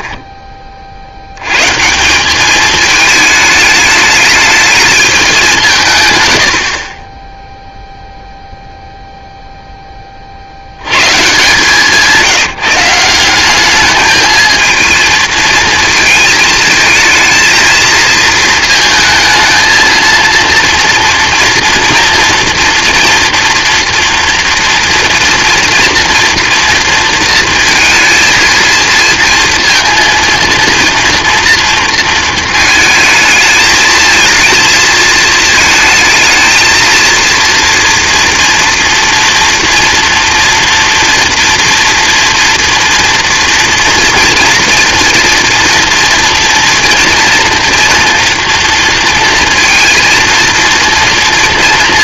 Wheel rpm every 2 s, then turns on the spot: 40, 210, 210, 60, 0, 110, 170, 220, 220, 220, 230, 230, 230, 230, 230, 230, 220, 230, 230, 230, 230, 230, 230, 230, 230, 230.
none